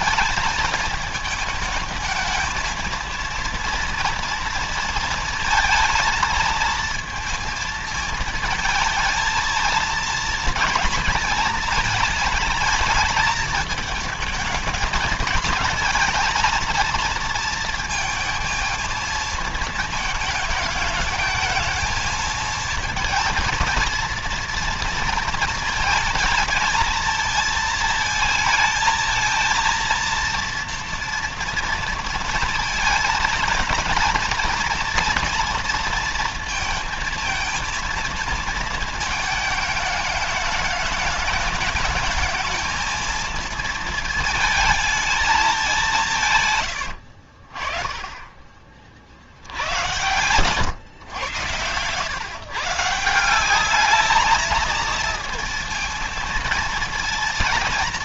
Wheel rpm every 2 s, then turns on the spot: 220, 220, 230, 220, 220, 230, 220, 220, 230, 220, 210, 230, 230, 220, 220, 230, 230, 230, 230, 220, 210, 220, 220, 130, 50, 120, 140, 220, 230.
46-48